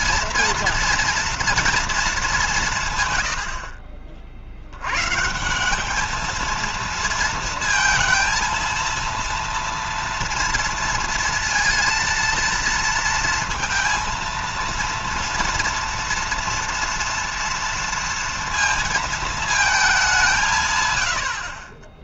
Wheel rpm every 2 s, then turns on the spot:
230, 150, 110, 230, 230, 230, 230, 230, 230, 230, 120.
none